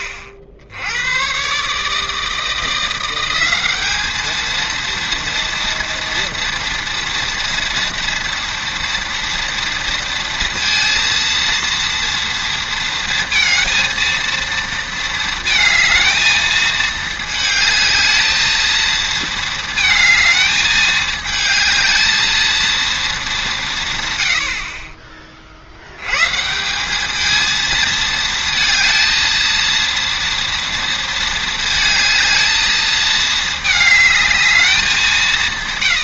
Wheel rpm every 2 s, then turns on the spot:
80, 170, 230, 230, 230, 230, 230, 230, 220, 220, 210, 230, 40, 190, 230, 230, 220, 200.
none